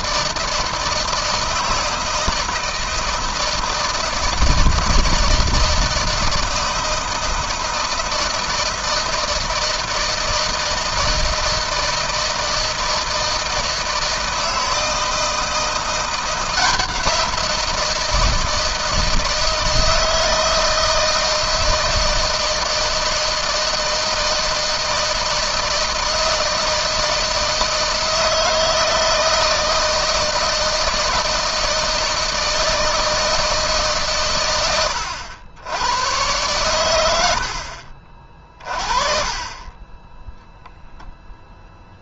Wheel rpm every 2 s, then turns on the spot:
160, 160, 160, 160, 160, 160, 160, 160, 170, 160, 160, 160, 160, 160, 160, 160, 160, 100, 90, 30, 0.
none